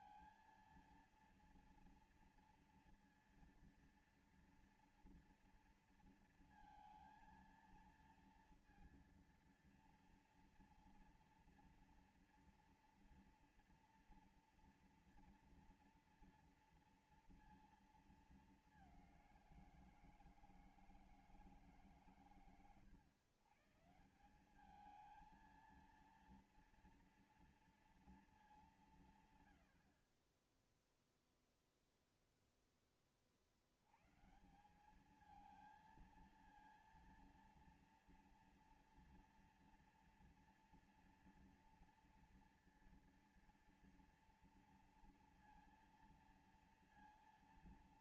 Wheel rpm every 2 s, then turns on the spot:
230, 230, 230, 230, 230, 240, 230, 230, 230, 220, 160, 140, 180, 230, 220, 0, 0, 150, 230, 230, 240, 240, 230, 230.
none